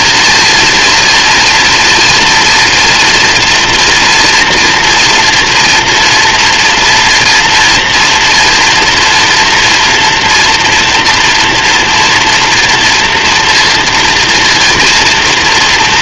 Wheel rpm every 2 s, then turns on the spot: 230, 240, 230, 230, 230, 230, 230, 230.
none